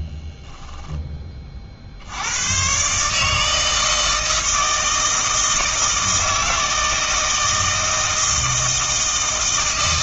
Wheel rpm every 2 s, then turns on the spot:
10, 130, 160, 160, 160.
none